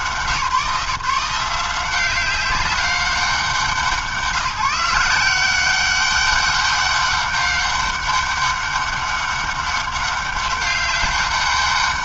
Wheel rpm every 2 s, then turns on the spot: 170, 190, 160, 190, 200, 200.
none